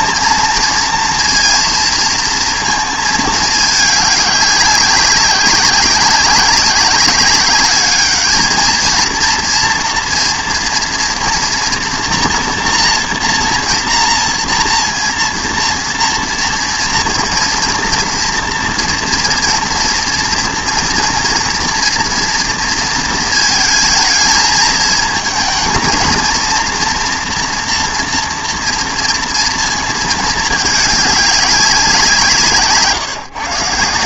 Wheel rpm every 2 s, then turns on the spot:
230, 220, 200, 190, 220, 230, 230, 230, 230, 230, 230, 230, 220, 230, 230, 210, 150.
none